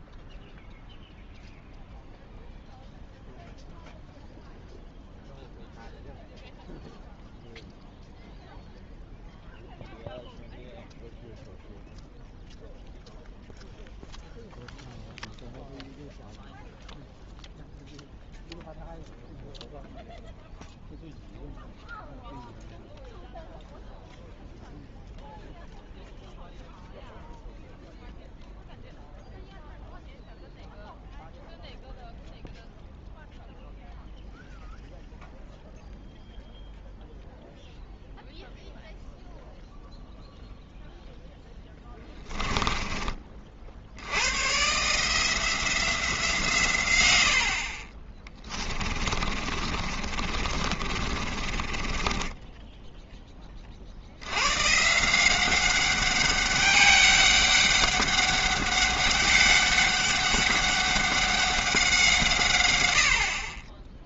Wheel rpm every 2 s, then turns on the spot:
0, 0, 0, 0, 0, 0, 0, 0, 0, 0, 0, 0, 0, 0, 0, 0, 0, 0, 0, 0, 0, 20, 130, 120, 20, 40, 10, 140, 200, 200, 200, 100.
42-44 48-54